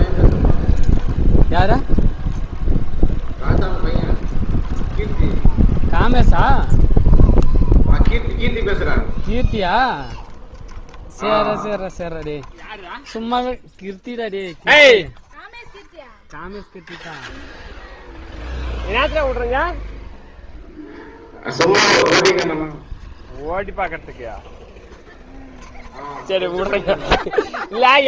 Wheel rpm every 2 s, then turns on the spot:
0, 0, 0, 0, 0, 0, 0, 0, 0, 0, 0, 0, 0, 0.
none